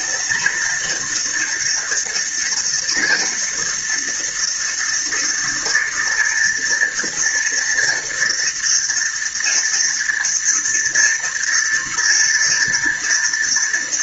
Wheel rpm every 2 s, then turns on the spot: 230, 230, 230, 230, 240, 230, 230.
none